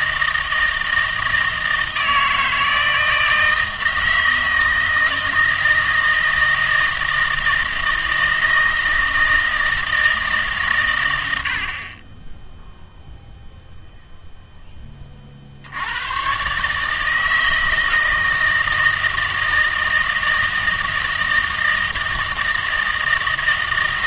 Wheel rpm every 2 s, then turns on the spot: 160, 160, 160, 160, 160, 140, 0, 10, 140, 160, 160, 160.
none